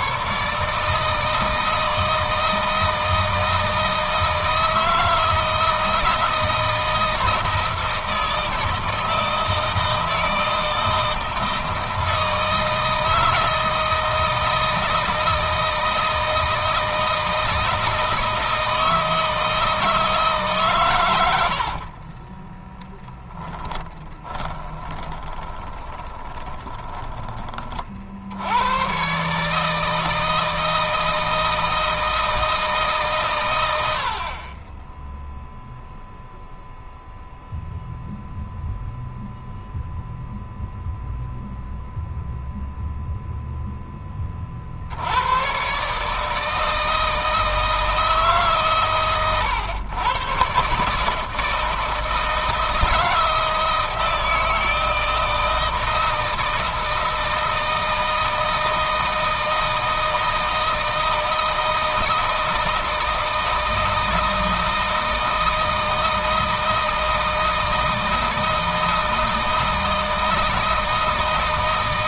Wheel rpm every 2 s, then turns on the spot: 150, 160, 160, 160, 160, 160, 160, 160, 160, 160, 130, 10, 20, 20, 90, 160, 160, 30, 0, 0, 0, 0, 60, 160, 140, 140, 160, 160, 160, 160, 160, 160, 160, 160, 160, 160.
22-28